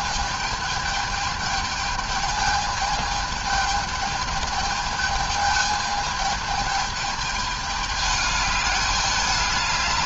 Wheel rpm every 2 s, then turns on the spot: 210, 210, 210, 220, 210.
none